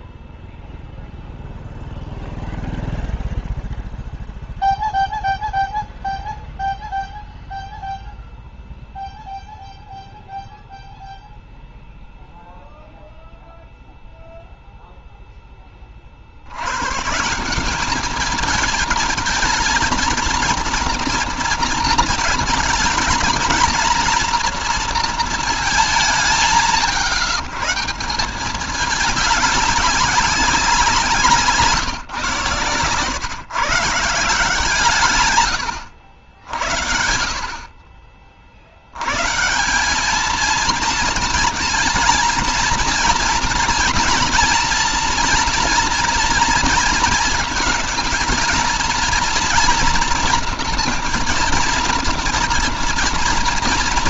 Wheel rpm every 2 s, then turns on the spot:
0, 0, 0, 0, 0, 0, 0, 0, 90, 220, 230, 220, 230, 150, 200, 190, 140, 160, 80, 60, 220, 230, 230, 230, 230, 240, 230.
none